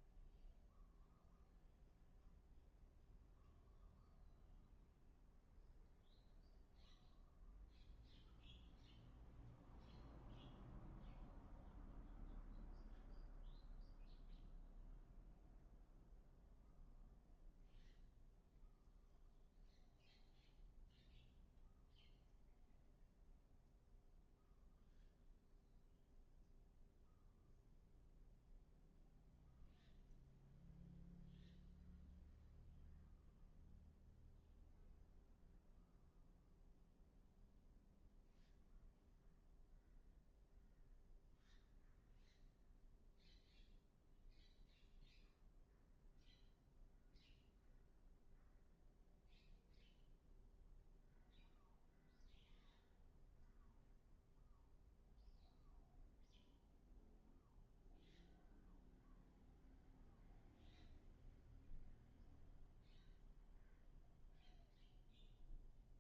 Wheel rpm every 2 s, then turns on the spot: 0, 0, 0, 0, 0, 0, 0, 0, 0, 0, 0, 0, 0, 0, 0, 0, 0, 0, 0, 0, 0, 0, 0, 0, 0, 0, 0, 0, 0, 0, 0, 0, 0.
none